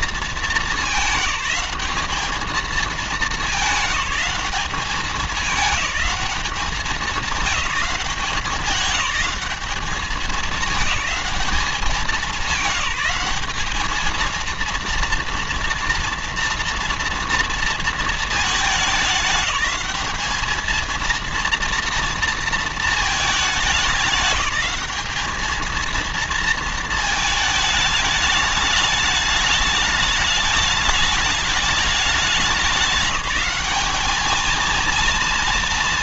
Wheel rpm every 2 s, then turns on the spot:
210, 210, 210, 210, 200, 200, 200, 230, 230, 210, 230, 220, 210, 220, 210, 210, 200, 230.
none